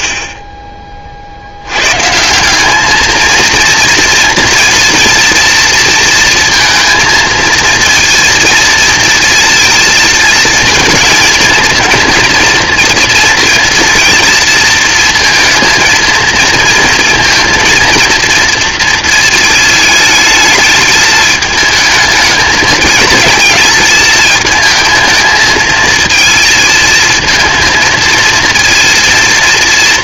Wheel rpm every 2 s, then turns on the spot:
20, 190, 230, 230, 230, 230, 230, 230, 230, 230, 220, 220, 220, 230, 230.
none